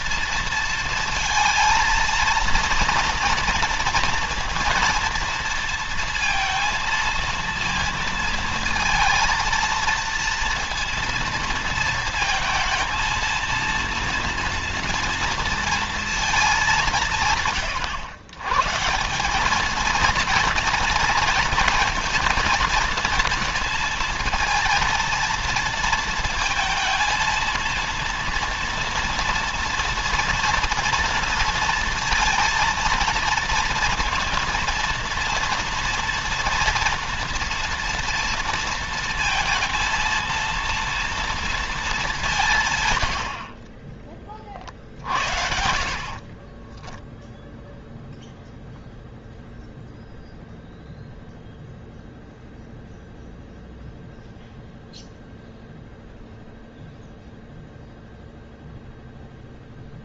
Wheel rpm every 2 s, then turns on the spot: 230, 230, 230, 230, 230, 230, 220, 230, 190, 160, 230, 230, 230, 230, 230, 230, 230, 230, 230, 230, 230, 120, 50, 20, 0, 0, 0, 0, 0, 0.
46-48